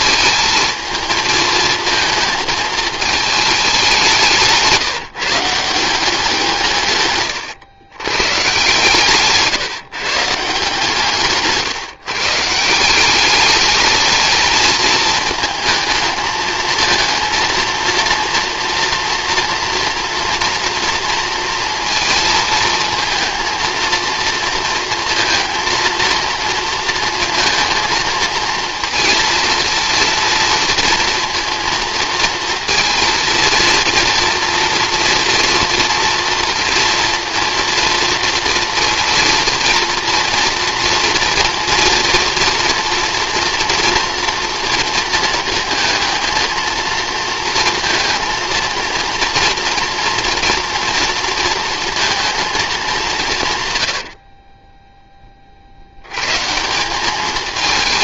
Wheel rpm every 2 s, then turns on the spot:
220, 220, 180, 120, 150, 150, 180, 220, 220, 230, 230, 230, 230, 230, 230, 230, 230, 230, 230, 230, 230, 230, 220, 230, 230, 230, 200, 20, 180.
54-56